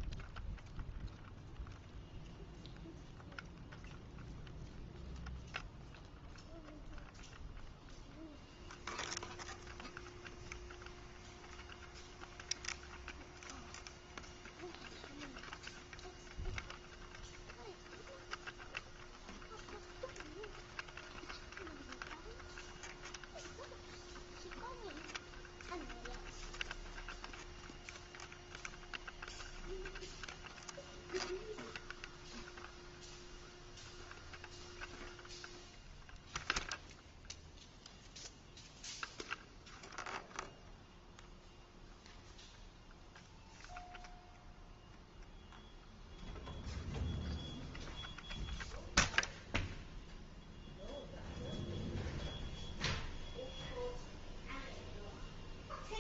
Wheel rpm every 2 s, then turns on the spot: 0, 0, 0, 0, 0, 0, 0, 0, 0, 0, 0, 0, 0, 0, 0, 0, 0, 0, 0, 0, 0, 0, 0, 0, 0, 0, 0, 0.
none